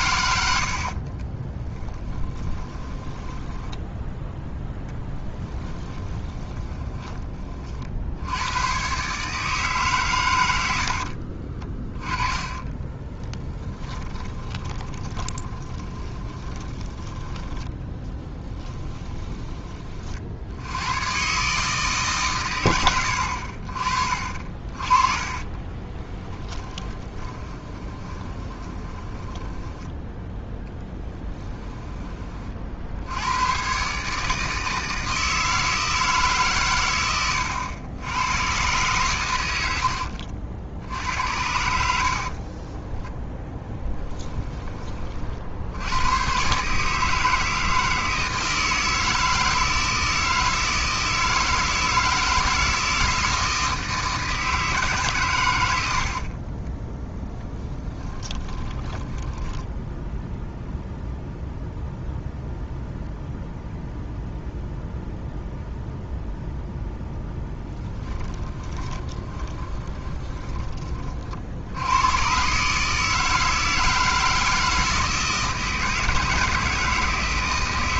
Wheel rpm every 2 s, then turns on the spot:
60, 20, 0, 20, 120, 80, 20, 20, 20, 20, 90, 100, 40, 20, 20, 20, 60, 160, 120, 120, 70, 10, 30, 150, 160, 160, 170, 150, 10, 20, 0, 0, 0, 0, 20, 30, 150, 160, 160.
0-4 6-8 10-20 26-32 42-44 56-60 68-70